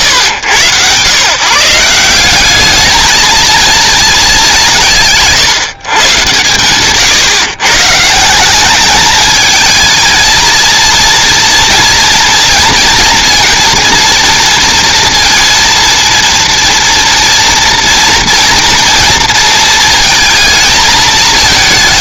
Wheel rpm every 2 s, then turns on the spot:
90, 210, 190, 140, 200, 230, 230, 230, 230, 230, 220.
none